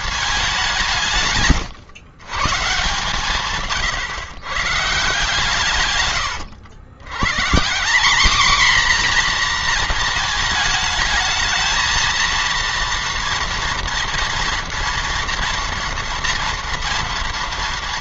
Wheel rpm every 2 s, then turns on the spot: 180, 140, 140, 110, 250, 220, 230, 230, 240.
none